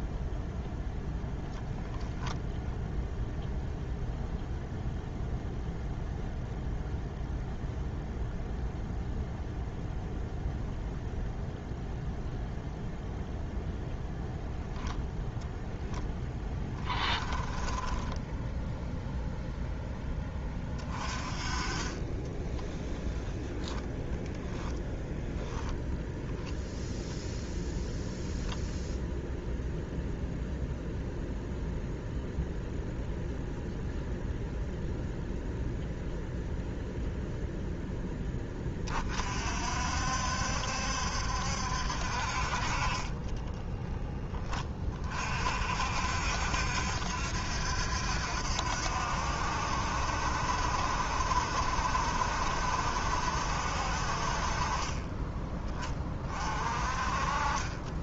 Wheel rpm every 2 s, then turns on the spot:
0, 0, 0, 0, 0, 0, 0, 0, 10, 0, 30, 10, 0, 0, 0, 0, 0, 0, 0, 30, 70, 30, 30, 70, 70, 70, 70, 30, 40.
16-18 42-44